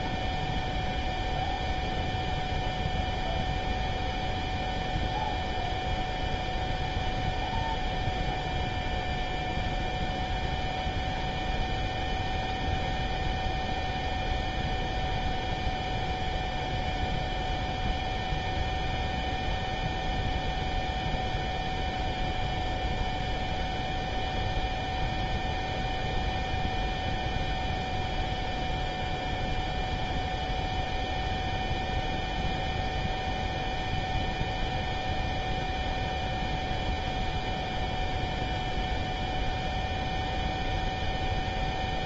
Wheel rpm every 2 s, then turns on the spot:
0, 0, 0, 0, 0, 0, 0, 0, 0, 0, 0, 0, 0, 0, 0, 0, 0, 0, 0, 0, 0.
none